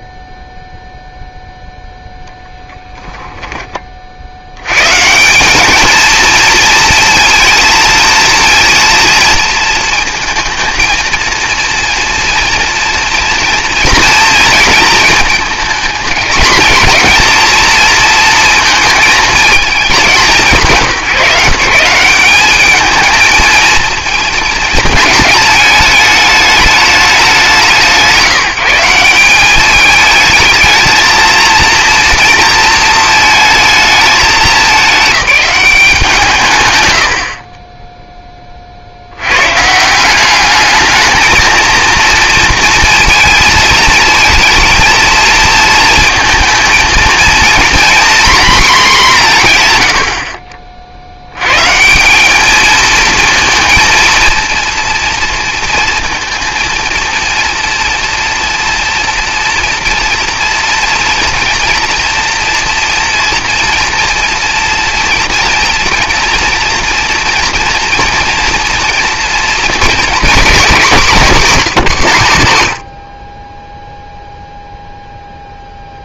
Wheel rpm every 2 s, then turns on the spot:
0, 10, 100, 230, 230, 220, 230, 230, 230, 230, 160, 210, 220, 210, 170, 220, 230, 210, 130, 30, 200, 230, 220, 230, 230, 50, 210, 230, 230, 240, 240, 230, 230, 240, 230, 220, 100, 0.
2-4